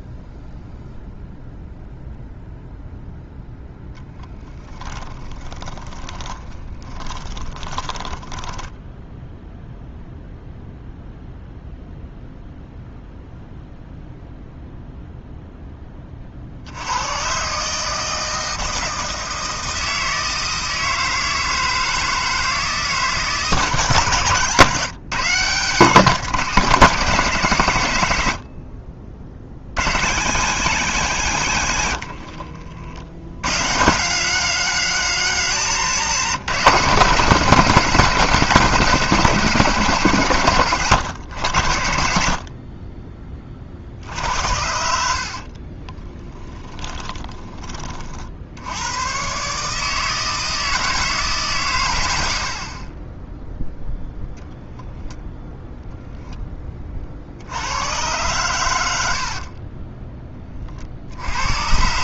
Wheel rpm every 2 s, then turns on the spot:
0, 0, 10, 20, 10, 0, 0, 0, 80, 160, 160, 160, 140, 180, 40, 130, 70, 190, 160, 160, 120, 40, 70, 20, 90, 160, 50, 0, 20, 100, 30.
4-10 44-48